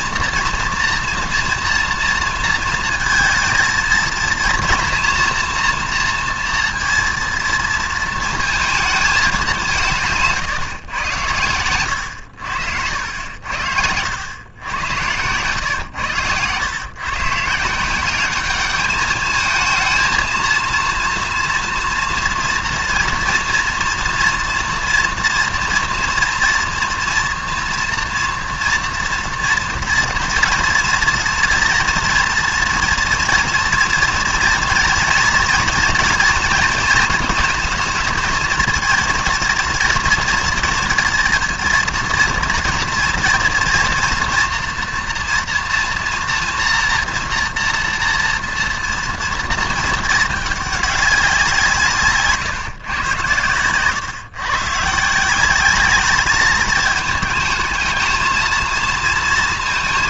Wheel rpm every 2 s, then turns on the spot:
230, 230, 230, 230, 230, 150, 80, 100, 120, 210, 230, 230, 230, 230, 230, 230, 230, 230, 230, 230, 230, 230, 230, 230, 230, 220, 150, 130, 210, 220.
14-16